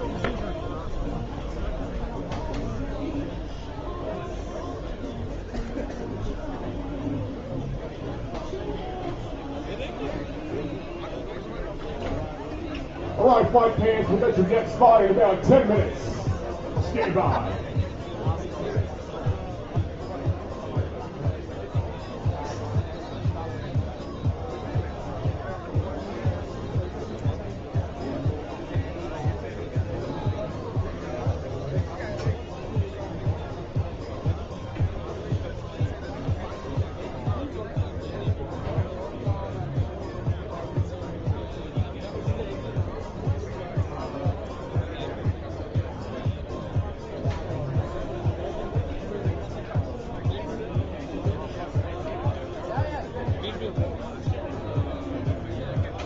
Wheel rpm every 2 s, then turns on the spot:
0, 0, 0, 0, 0, 0, 0, 0, 0, 0, 0, 0, 0, 0, 0, 0, 0, 0, 0, 0, 0, 0, 0, 0, 0, 0, 0, 0.
none